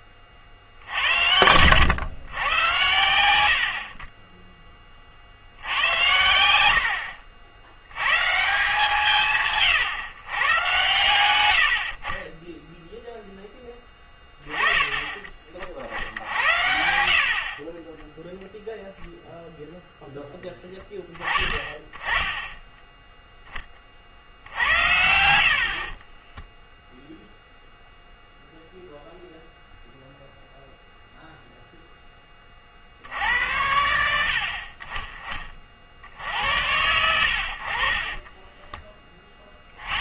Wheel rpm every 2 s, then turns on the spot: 50, 110, 10, 70, 160, 120, 0, 20, 70, 0, 10, 10, 80, 0, 0, 0, 40, 50, 90, 20.
6-8 24-26 38-40